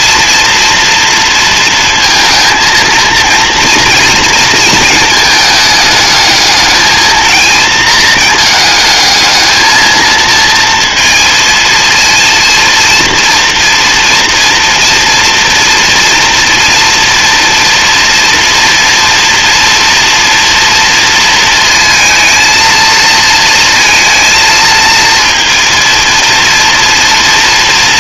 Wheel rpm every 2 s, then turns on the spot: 230, 220, 220, 220, 220, 230, 230, 230, 240, 230, 230, 230, 230, 230.
none